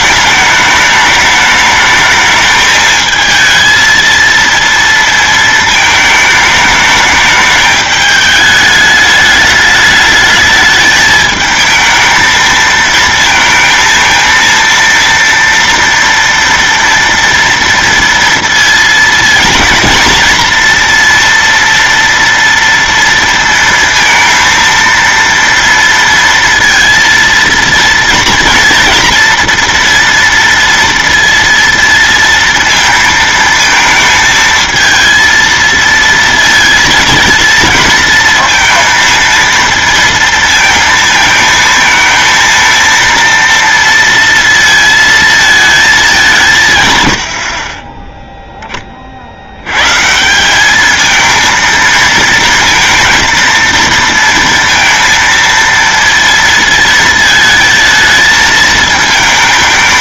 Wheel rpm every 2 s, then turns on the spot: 210, 220, 230, 220, 210, 210, 220, 230, 230, 230, 230, 230, 230, 230, 230, 230, 230, 220, 230, 230, 220, 230, 230, 190, 0, 160, 230, 230, 230, 220.
none